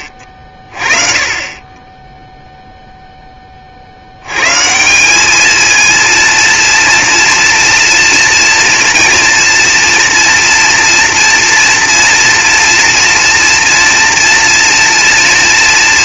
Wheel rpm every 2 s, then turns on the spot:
20, 40, 220, 230, 230, 230, 230, 240.
none